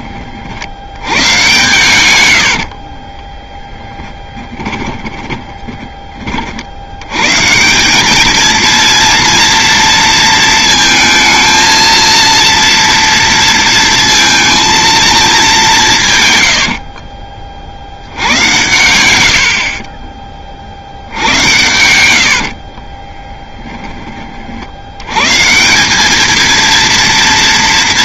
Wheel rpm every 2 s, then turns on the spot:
80, 50, 20, 70, 230, 220, 230, 230, 80, 100, 50, 40, 60, 230.
2-6 16-20 22-24